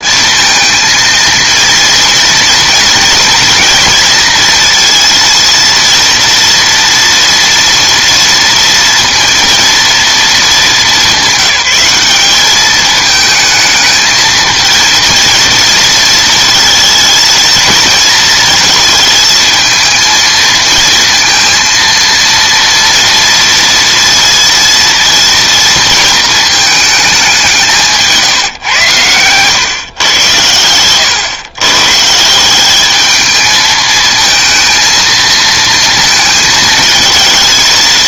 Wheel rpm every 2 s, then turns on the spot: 230, 230, 230, 230, 230, 210, 210, 220, 230, 220, 230, 230, 230, 220, 130, 100, 190, 230, 220.
none